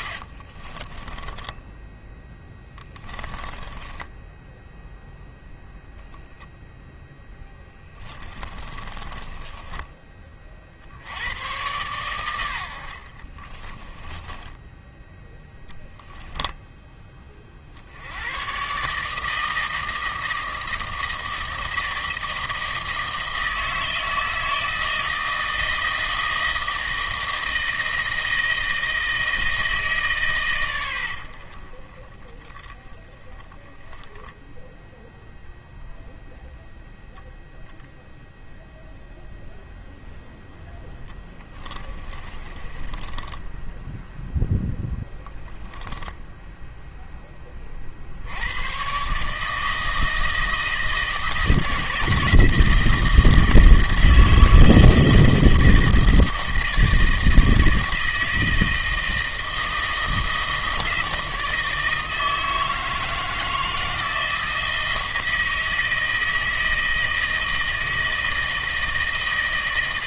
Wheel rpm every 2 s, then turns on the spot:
30, 20, 0, 0, 20, 60, 70, 10, 10, 140, 160, 160, 160, 160, 160, 100, 20, 0, 0, 0, 10, 20, 0, 0, 110, 160, 160, 170, 160, 160, 160, 160, 160, 160, 160.
0-4 8-10 14-16 42-44